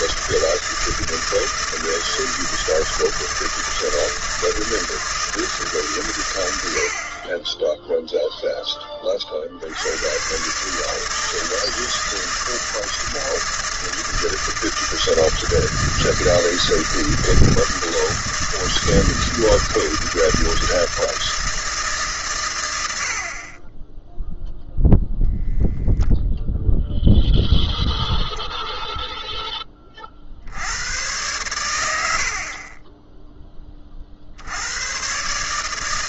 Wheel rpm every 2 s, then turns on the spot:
160, 170, 160, 90, 10, 140, 160, 160, 160, 160, 160, 100, 0, 0, 0, 70, 40, 100.
none